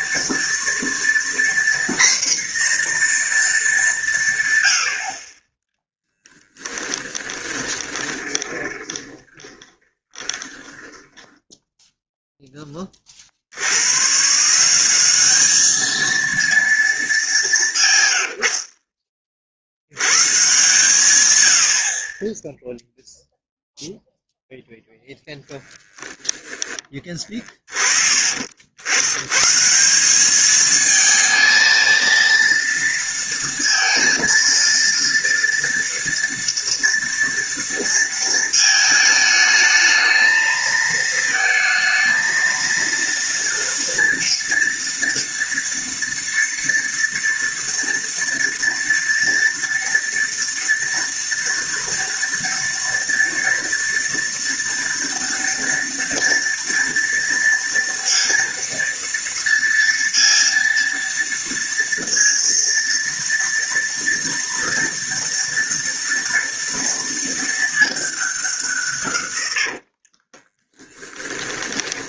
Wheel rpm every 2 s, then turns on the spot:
230, 240, 110, 10, 30, 20, 10, 160, 230, 90, 120, 0, 0, 10, 60, 210, 230, 230, 230, 220, 220, 230, 230, 240, 230, 230, 230, 230, 230, 230, 230, 230, 230, 230, 190, 30.
6-12 26-28 70-72